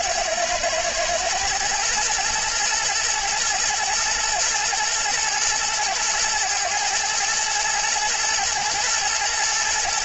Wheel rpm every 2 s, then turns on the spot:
110, 120, 120, 110, 110.
none